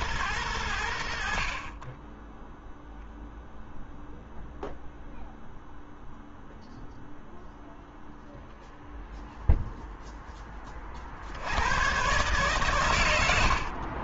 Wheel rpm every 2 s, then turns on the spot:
70, 0, 0, 0, 0, 40, 110.
none